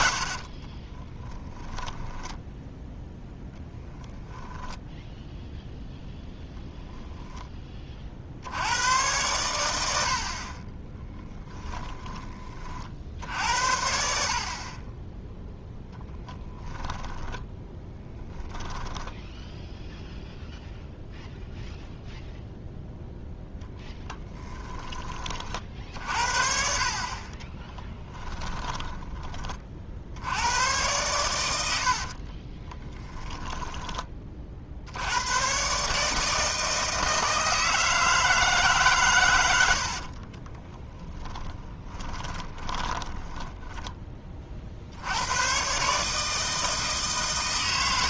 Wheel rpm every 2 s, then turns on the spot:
40, 0, 0, 0, 100, 30, 50, 30, 10, 10, 0, 0, 20, 40, 20, 110, 20, 60, 160, 140, 30, 20, 70, 160.
0-2 10-12 16-20 24-30 32-34 40-44